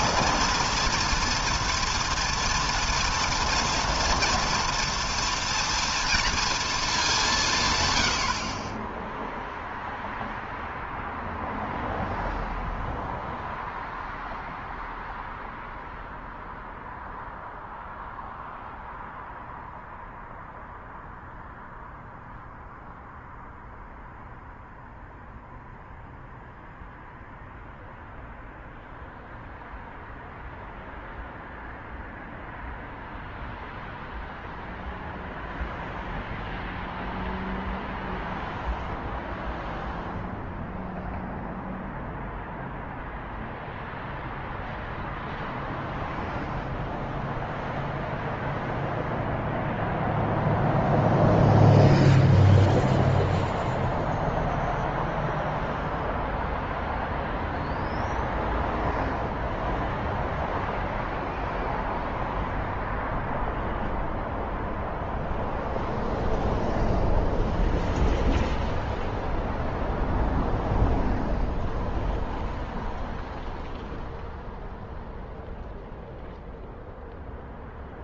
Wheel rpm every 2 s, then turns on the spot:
230, 230, 230, 230, 50, 0, 0, 0, 0, 0, 0, 0, 0, 0, 0, 0, 0, 0, 0, 0, 0, 0, 0, 0, 0, 0, 0, 0, 0, 0, 0, 0, 0, 0, 0, 0, 0, 0, 0.
8-10